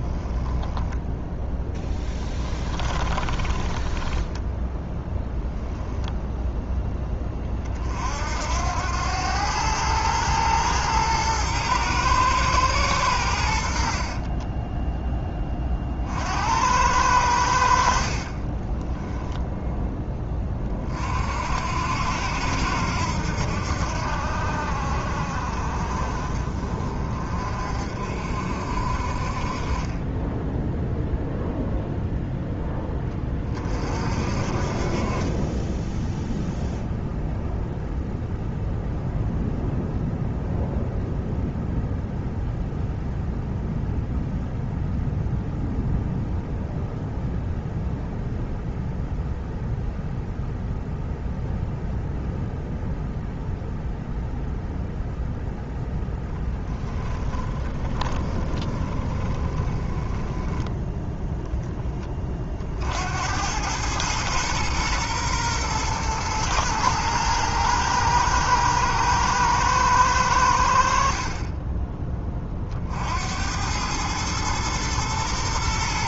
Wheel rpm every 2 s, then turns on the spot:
10, 20, 10, 10, 80, 110, 110, 20, 80, 30, 30, 80, 60, 40, 50, 0, 10, 40, 0, 0, 0, 0, 0, 0, 0, 0, 0, 0, 10, 20, 10, 60, 120, 110, 110, 60, 60, 120.
0-6 14-16 18-20 56-60